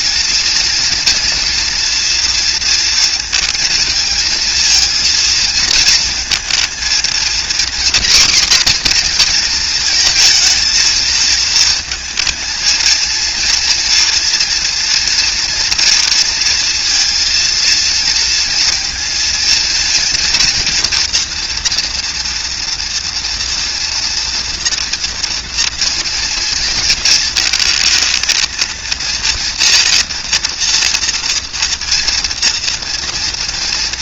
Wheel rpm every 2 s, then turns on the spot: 230, 230, 230, 230, 250, 220, 230, 230, 230, 230, 230, 230, 230, 230, 230, 230, 230.
none